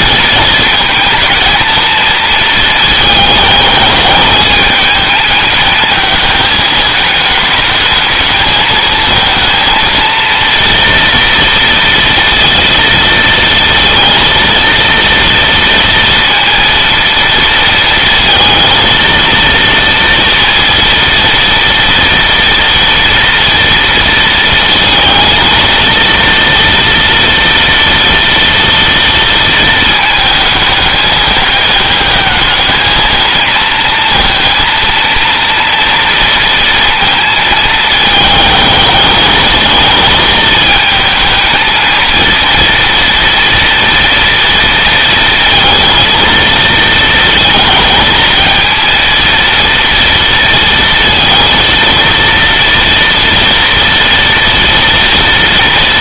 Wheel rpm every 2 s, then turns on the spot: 230, 220, 210, 220, 220, 230, 230, 230, 230, 230, 230, 240, 230, 230, 230, 220, 220, 230, 230, 220, 220, 230, 230, 230, 230, 230, 230, 230.
none